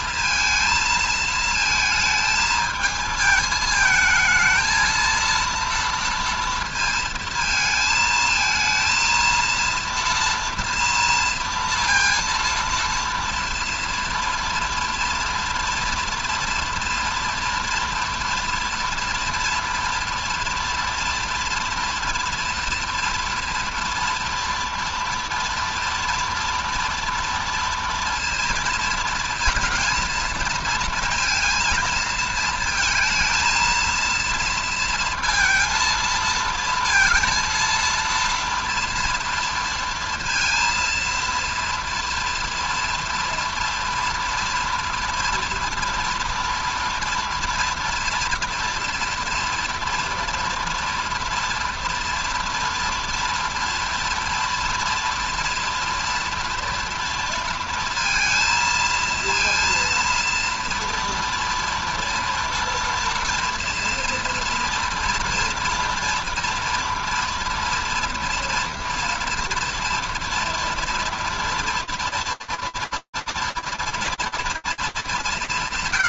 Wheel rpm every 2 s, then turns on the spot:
220, 220, 230, 230, 230, 230, 230, 230, 230, 230, 230, 230, 230, 240, 230, 230, 220, 230, 230, 230, 230, 230, 230, 230, 240, 230, 230, 230, 230, 230, 230, 230, 230, 230, 230, 230, 230, 140.
none